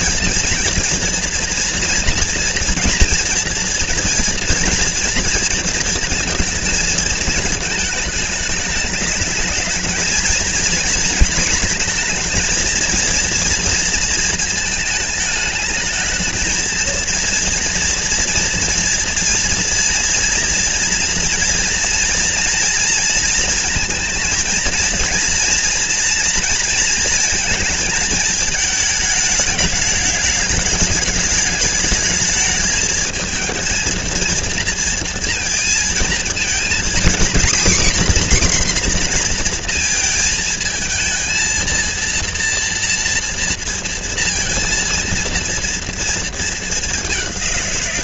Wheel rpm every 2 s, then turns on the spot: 230, 230, 230, 220, 210, 230, 230, 220, 230, 230, 230, 230, 230, 230, 220, 210, 220, 230, 240, 250, 220, 240, 230, 200.
none